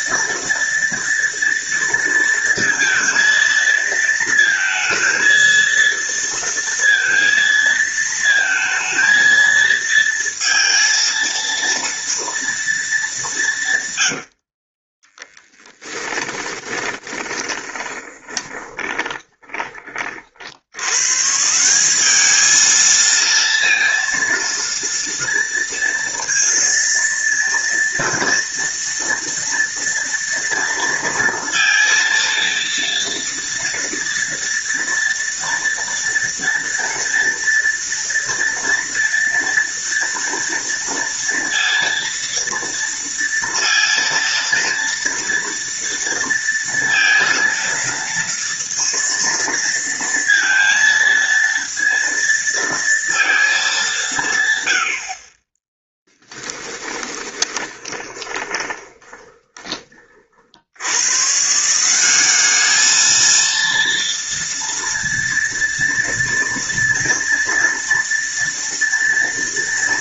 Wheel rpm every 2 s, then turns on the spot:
230, 230, 220, 230, 230, 230, 220, 30, 10, 20, 120, 220, 230, 230, 230, 230, 230, 230, 230, 230, 230, 230, 230, 230, 230, 230, 230, 80, 20, 20, 90, 220, 230, 230, 230.
14-20 56-60